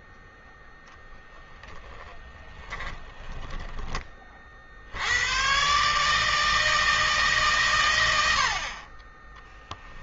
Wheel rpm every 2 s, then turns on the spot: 0, 10, 60, 160, 20.
2-4 8-10